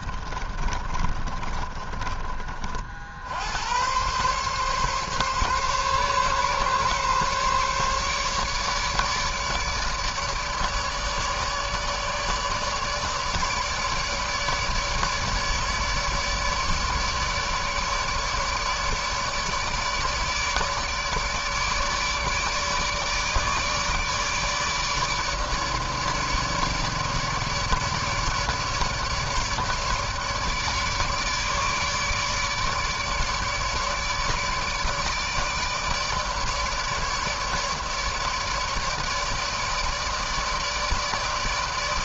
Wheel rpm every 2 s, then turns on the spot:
30, 40, 130, 140, 150, 150, 150, 150, 150, 150, 150, 150, 150, 150, 150, 150, 150, 150, 150, 150, 160.
0-2